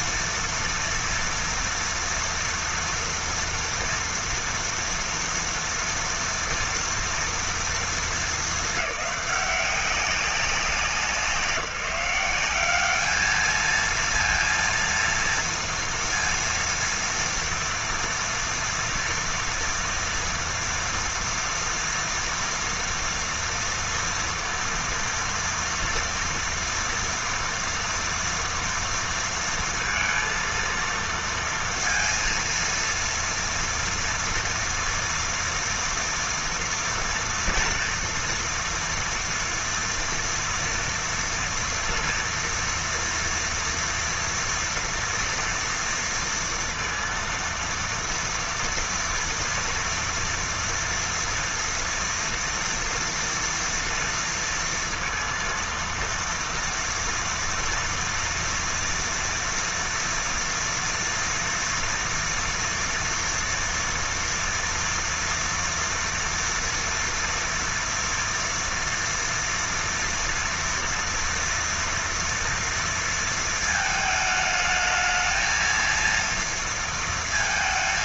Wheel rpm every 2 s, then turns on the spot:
230, 230, 230, 230, 200, 190, 210, 230, 230, 230, 230, 230, 230, 230, 230, 230, 230, 230, 230, 230, 240, 230, 230, 230, 230, 230, 230, 230, 230, 240, 230, 230, 240, 230, 230, 230, 230, 220, 230.
none